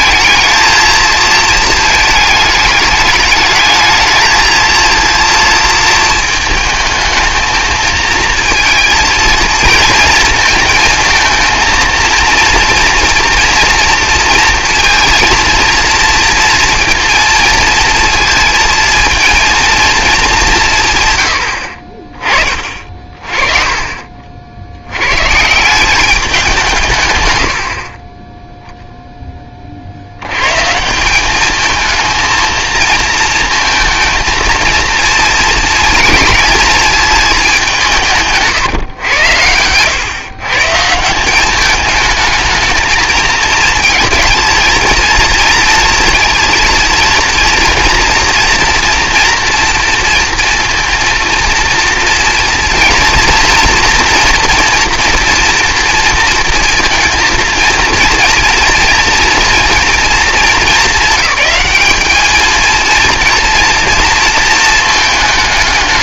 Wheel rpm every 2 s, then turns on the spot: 220, 210, 230, 220, 230, 220, 230, 230, 230, 230, 170, 40, 80, 180, 0, 140, 230, 230, 220, 140, 140, 220, 230, 230, 240, 230, 230, 240, 230, 230, 220, 220, 220.
22-24